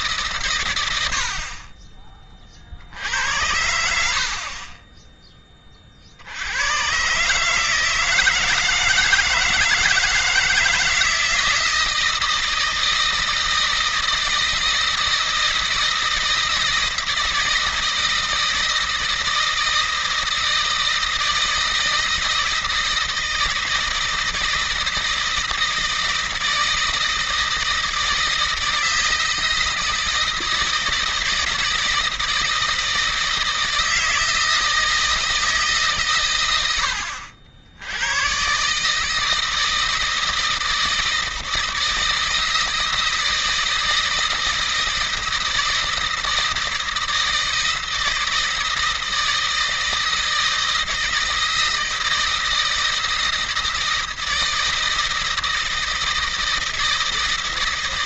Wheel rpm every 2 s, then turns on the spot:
110, 50, 30, 100, 160, 160, 160, 160, 160, 160, 160, 160, 160, 160, 160, 160, 160, 160, 90, 140, 160, 160, 160, 160, 160, 160, 160, 160, 160.
none